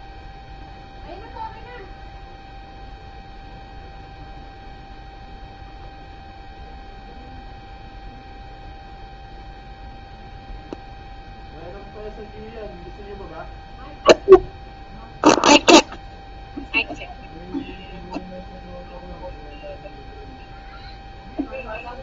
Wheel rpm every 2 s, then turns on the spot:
0, 0, 0, 0, 0, 0, 0, 0, 0, 0, 0.
none